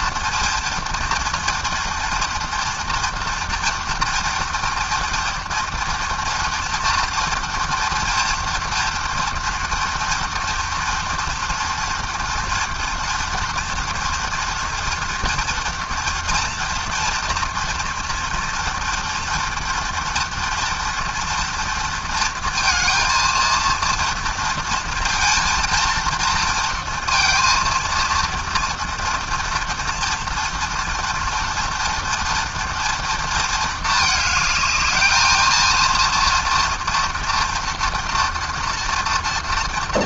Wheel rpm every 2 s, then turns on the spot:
230, 230, 230, 230, 230, 230, 230, 240, 230, 230, 230, 230, 230, 230, 230, 230, 230, 220, 230, 230.
none